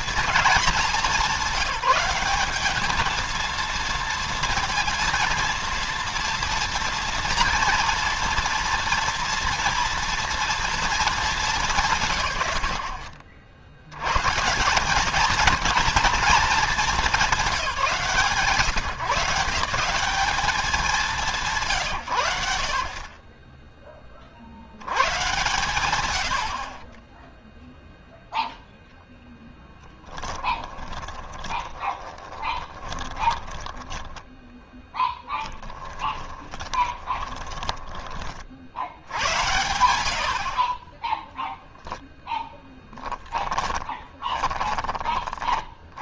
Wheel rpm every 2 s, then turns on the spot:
210, 200, 230, 230, 230, 230, 100, 190, 220, 150, 200, 80, 80, 20, 0, 20, 20, 20, 20, 70, 20, 20, 20.
30-38 40-44